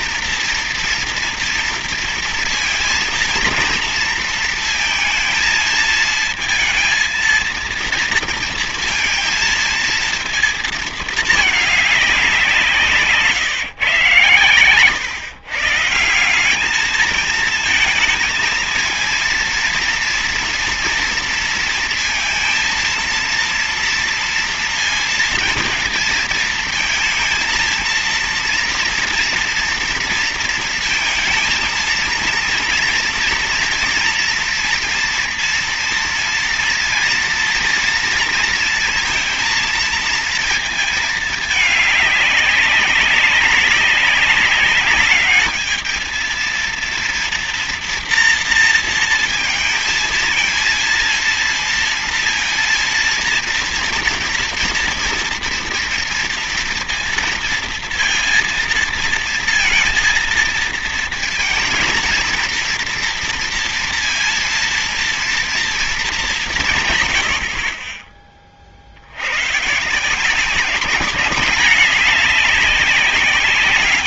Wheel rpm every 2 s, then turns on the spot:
230, 230, 230, 230, 230, 220, 170, 130, 210, 230, 230, 230, 230, 220, 230, 230, 230, 230, 230, 230, 220, 200, 200, 230, 230, 230, 230, 230, 230, 230, 230, 230, 230, 180, 50, 180, 200.
none